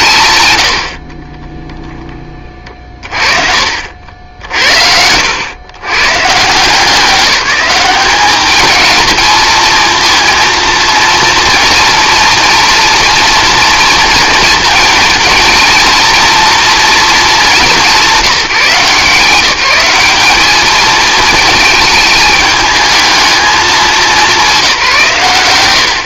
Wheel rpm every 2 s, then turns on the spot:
80, 30, 70, 160, 220, 230, 240, 230, 230, 160, 210, 220, 180.
4-6